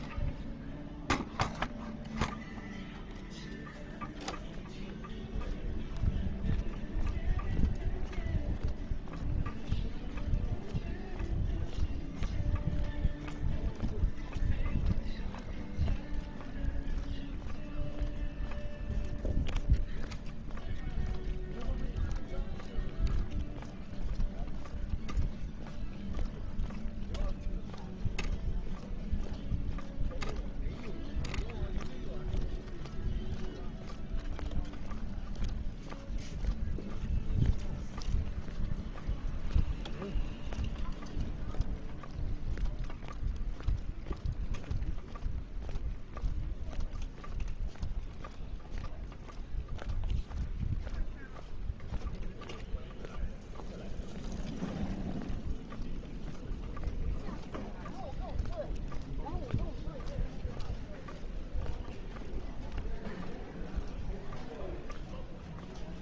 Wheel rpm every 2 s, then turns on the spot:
0, 0, 0, 0, 0, 0, 0, 0, 0, 0, 0, 0, 0, 0, 0, 0, 0, 0, 0, 0, 0, 0, 0, 0, 0, 0, 0, 0, 0, 0, 0, 0, 0.
none